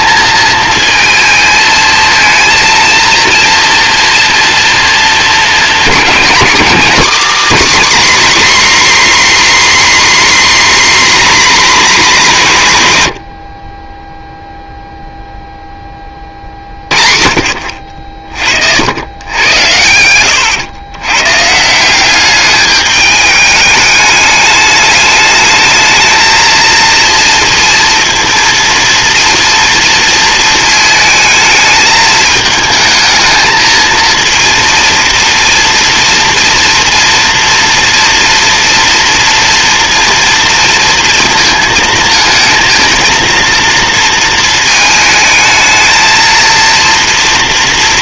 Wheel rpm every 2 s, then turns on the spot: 220, 230, 230, 260, 270, 270, 100, 0, 40, 90, 120, 210, 210, 230, 230, 220, 220, 230, 230, 230, 230, 230, 220, 240.
none